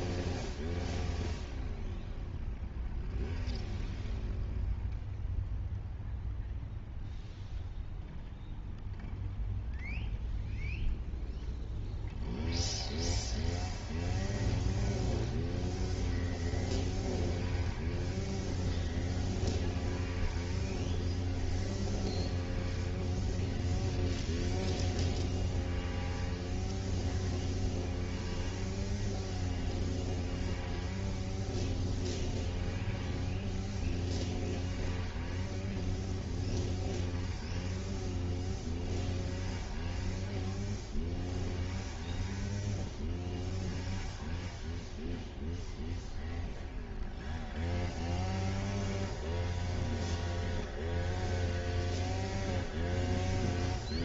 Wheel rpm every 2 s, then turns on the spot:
0, 0, 0, 0, 0, 0, 0, 0, 0, 0, 0, 0, 0, 0, 0, 0, 0, 0, 0, 0, 0, 0, 0, 0, 0, 0, 0.
none